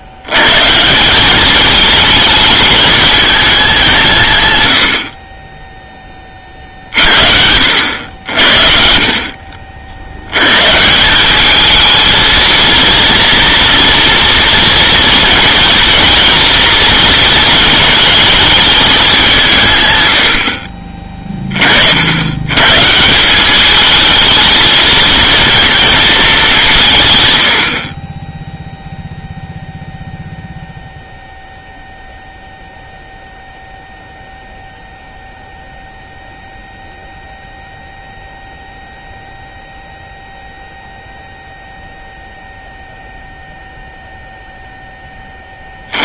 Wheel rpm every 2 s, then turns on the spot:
140, 210, 100, 50, 50, 140, 230, 230, 230, 210, 40, 140, 220, 180, 0, 0, 0, 0, 0, 0, 0, 0, 10.
none